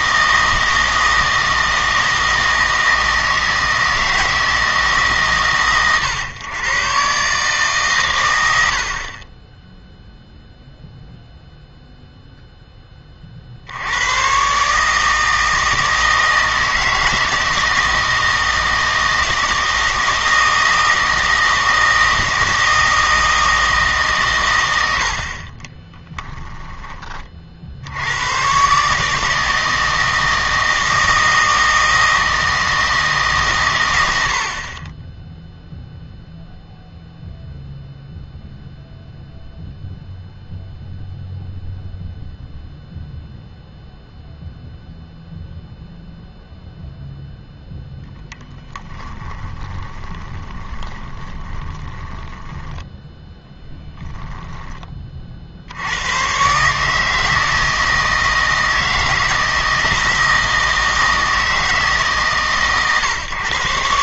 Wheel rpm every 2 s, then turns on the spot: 160, 160, 160, 120, 70, 0, 10, 140, 160, 170, 160, 160, 110, 10, 140, 160, 160, 30, 0, 0, 0, 0, 0, 0, 10, 20, 10, 20, 140, 160, 160, 130.
48-54